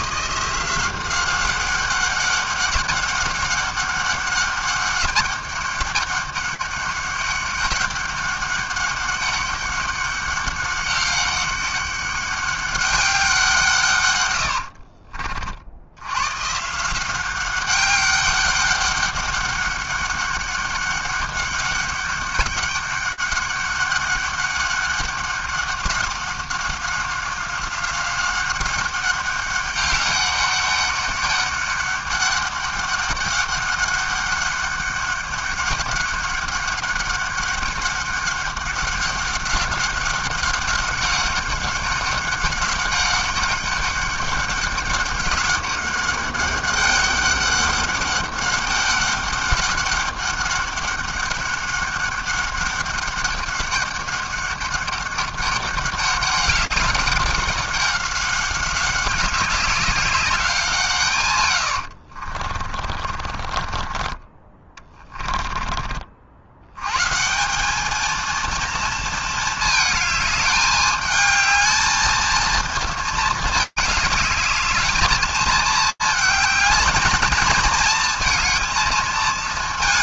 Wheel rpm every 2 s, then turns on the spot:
180, 190, 200, 200, 200, 200, 200, 100, 130, 200, 200, 200, 200, 190, 190, 200, 200, 200, 200, 200, 190, 200, 200, 200, 200, 200, 200, 200, 190, 190, 180, 50, 40, 70, 230, 210, 220, 210, 220, 230.
62-64